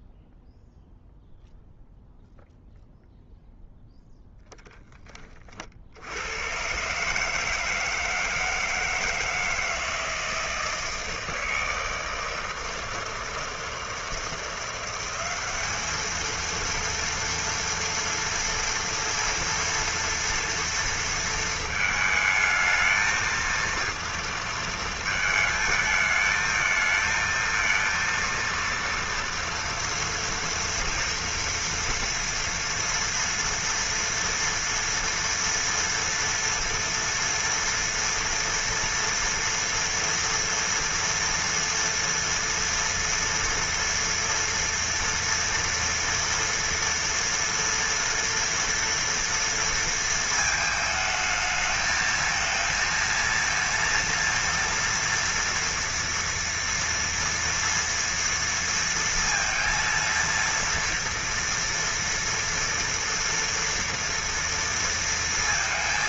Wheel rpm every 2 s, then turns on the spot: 0, 0, 10, 110, 160, 160, 160, 170, 230, 230, 230, 220, 230, 220, 230, 230, 240, 230, 230, 230, 240, 230, 230, 240, 230, 220, 230, 240, 230, 230, 230, 230, 230.
none